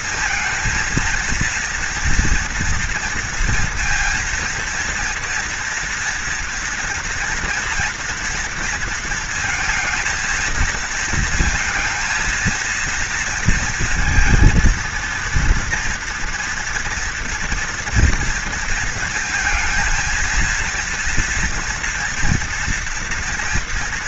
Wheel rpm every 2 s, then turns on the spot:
230, 230, 230, 230, 230, 230, 230, 230, 240, 220, 230, 230.
none